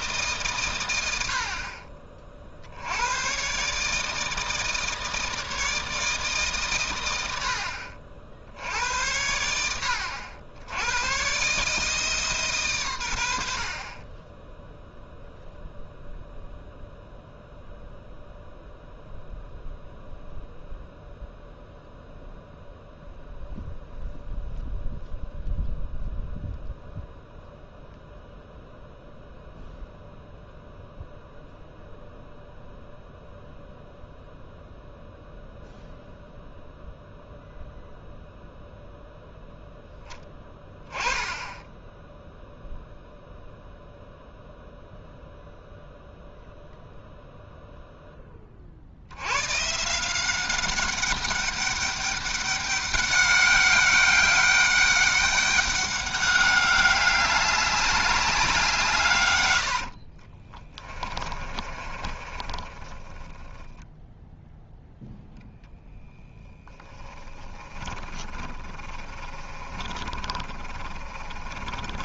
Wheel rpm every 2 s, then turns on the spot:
120, 70, 160, 120, 80, 100, 120, 0, 0, 0, 0, 0, 0, 0, 0, 0, 0, 0, 0, 0, 10, 0, 0, 0, 50, 200, 200, 200, 200, 170, 20, 20, 0, 10, 30, 40.
60-64 68-72